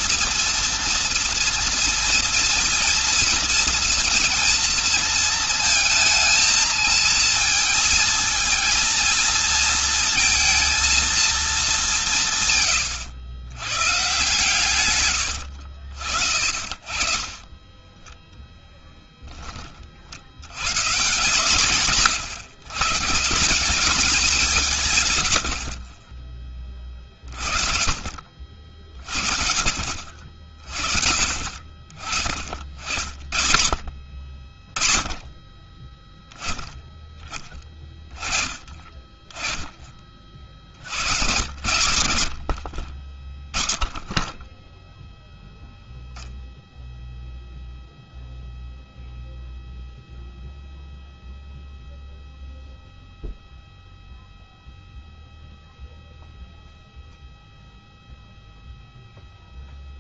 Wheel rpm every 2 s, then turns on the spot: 230, 230, 230, 220, 230, 230, 110, 120, 40, 10, 130, 140, 140, 20, 40, 40, 50, 20, 10, 20, 70, 40, 0, 0, 0, 0, 0, 0, 0, 0.
16-18